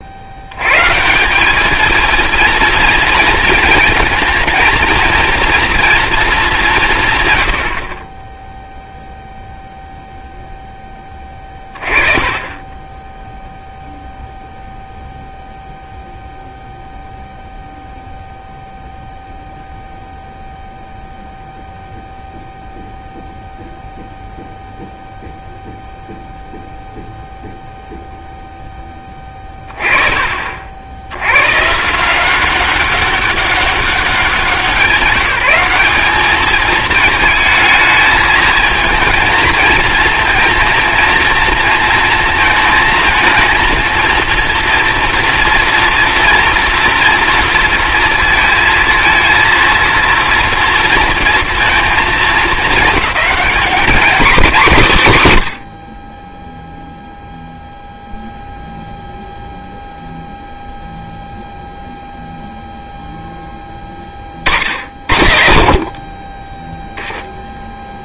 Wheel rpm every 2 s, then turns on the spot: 100, 230, 230, 180, 0, 10, 20, 0, 0, 0, 0, 0, 0, 0, 10, 60, 190, 190, 220, 220, 230, 230, 230, 240, 230, 230, 210, 200, 0, 0, 0, 0, 60, 20.
none